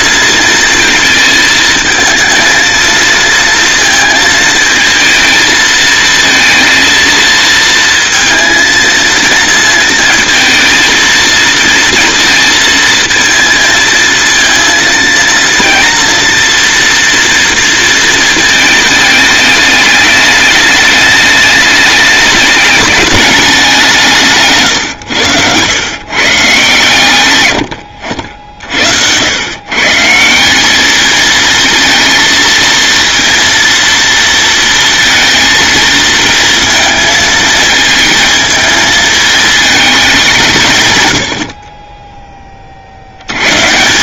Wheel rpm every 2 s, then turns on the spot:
220, 230, 220, 230, 230, 230, 230, 230, 240, 210, 200, 210, 130, 130, 80, 220, 230, 230, 230, 220, 110, 70.
none